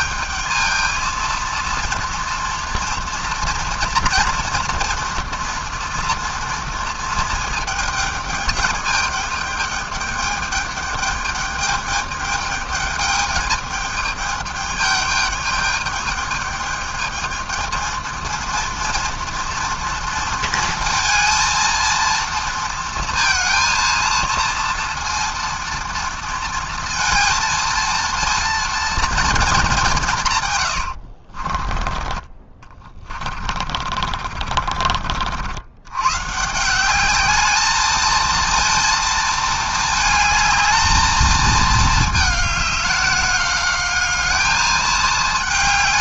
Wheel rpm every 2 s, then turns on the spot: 220, 230, 230, 230, 210, 210, 210, 210, 210, 230, 230, 230, 230, 230, 230, 120, 30, 30, 160, 230, 220, 210, 220.
30-36